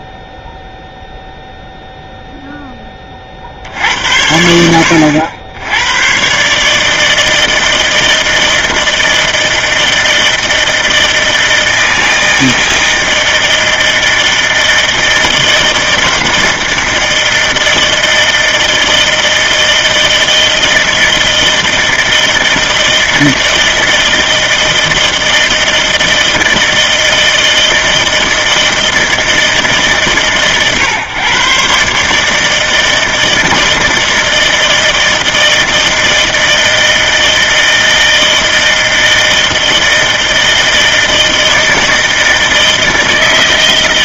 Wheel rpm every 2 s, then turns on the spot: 0, 0, 80, 140, 160, 160, 160, 160, 160, 160, 160, 160, 160, 160, 160, 130, 160, 160, 160, 160, 160, 160.
none